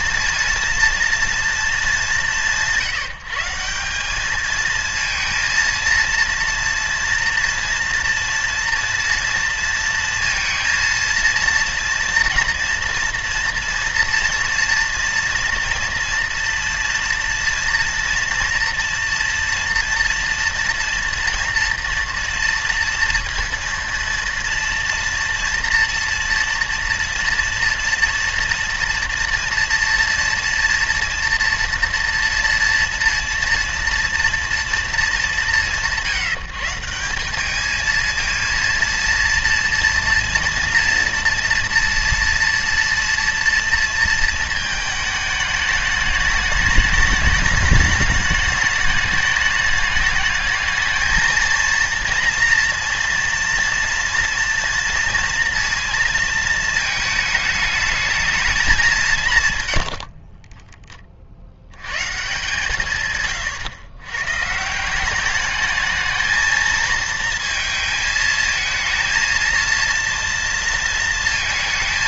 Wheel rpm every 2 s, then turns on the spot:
230, 160, 220, 230, 230, 230, 230, 240, 230, 230, 230, 230, 240, 240, 230, 240, 230, 230, 170, 230, 230, 230, 220, 210, 210, 220, 230, 230, 220, 200, 10, 160, 160, 220, 220, 230.
none